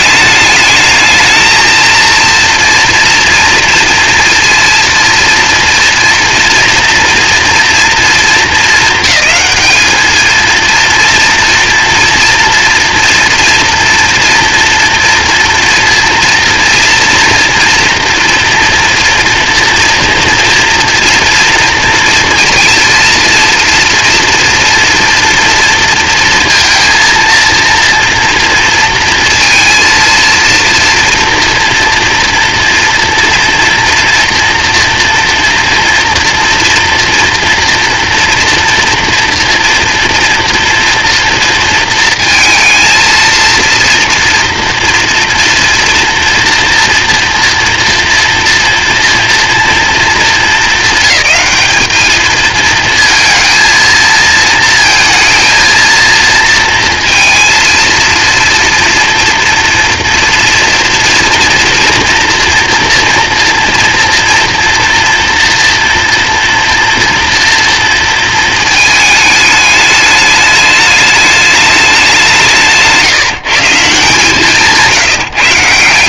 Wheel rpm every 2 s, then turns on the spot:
220, 230, 230, 230, 220, 230, 240, 230, 230, 230, 230, 230, 230, 230, 230, 230, 230, 230, 230, 230, 230, 220, 230, 230, 230, 220, 230, 230, 230, 230, 230, 240, 240, 230, 220, 210, 160, 170.
none